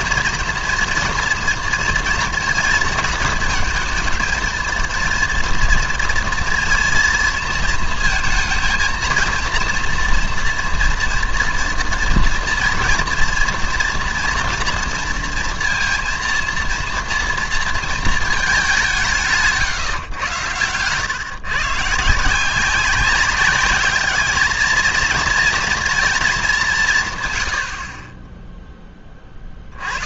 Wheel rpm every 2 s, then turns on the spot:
230, 230, 230, 230, 230, 230, 230, 230, 230, 190, 110, 180, 220, 180, 10.
none